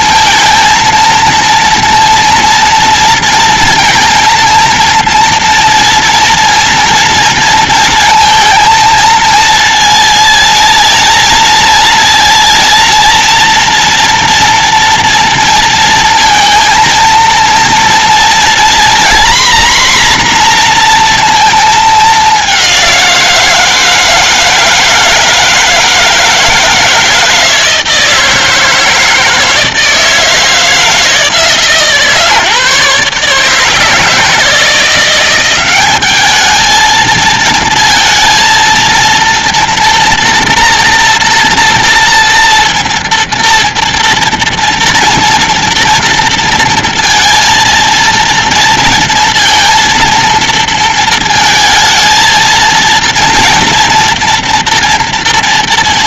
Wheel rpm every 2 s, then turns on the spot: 230, 230, 230, 240, 230, 230, 230, 230, 220, 240, 240, 180, 160, 160, 160, 160, 140, 170, 220, 230, 230, 230, 230, 230, 230, 230, 230, 230.
none